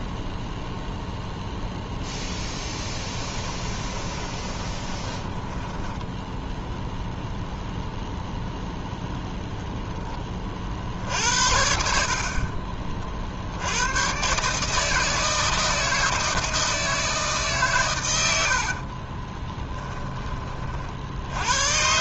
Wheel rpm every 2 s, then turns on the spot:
0, 10, 10, 0, 0, 60, 40, 160, 160, 50, 50.
2-6 18-20